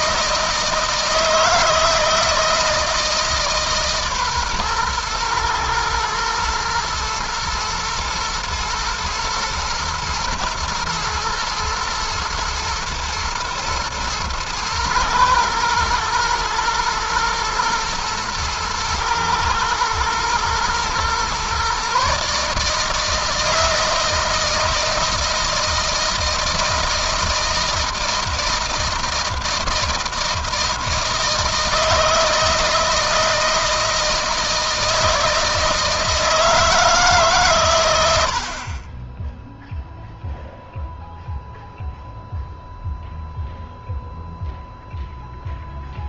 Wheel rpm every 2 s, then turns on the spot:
160, 160, 120, 120, 110, 120, 110, 120, 110, 110, 120, 150, 160, 160, 160, 160, 160, 160, 150, 20, 0, 0, 0.
none